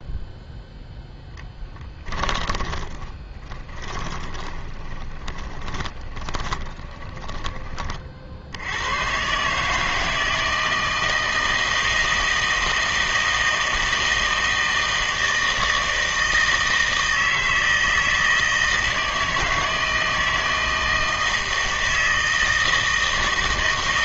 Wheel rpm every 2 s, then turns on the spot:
0, 20, 20, 10, 70, 160, 160, 160, 160, 160, 160, 160.
2-8